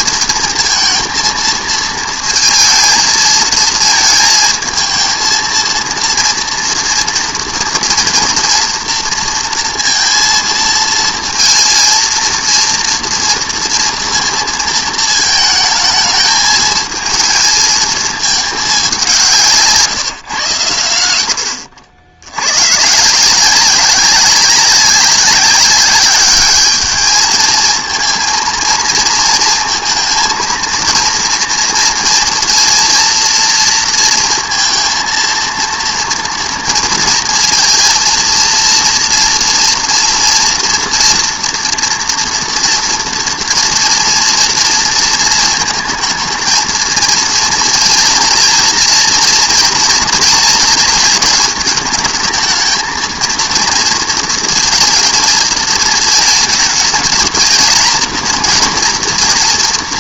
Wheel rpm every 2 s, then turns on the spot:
230, 220, 230, 230, 240, 230, 230, 230, 220, 200, 110, 110, 190, 210, 230, 230, 230, 230, 230, 230, 240, 230, 230, 220, 230, 230, 220, 230, 220, 230.
none